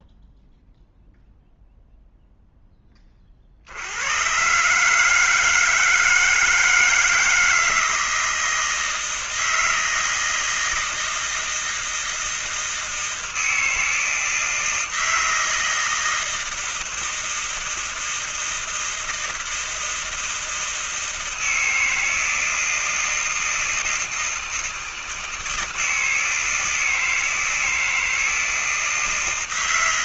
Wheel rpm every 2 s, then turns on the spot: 0, 0, 100, 160, 160, 160, 160, 160, 160, 160, 160, 160, 160, 160, 160.
none